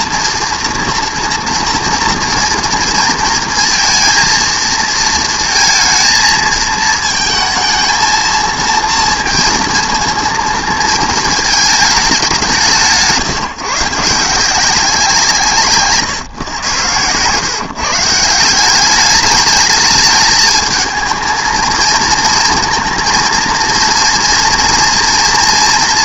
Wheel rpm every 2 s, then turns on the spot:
230, 230, 230, 220, 230, 230, 180, 190, 110, 180, 220, 230, 230.
none